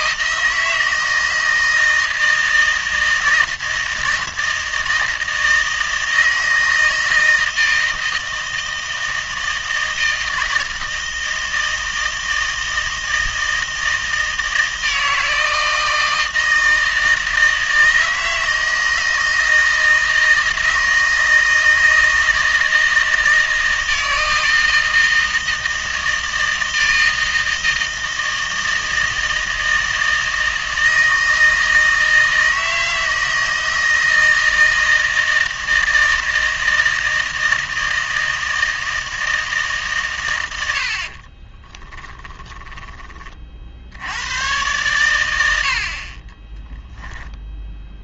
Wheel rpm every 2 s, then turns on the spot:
160, 160, 160, 160, 160, 160, 160, 160, 160, 160, 160, 160, 160, 160, 160, 160, 160, 160, 160, 160, 90, 20, 110, 10.
42-44 46-48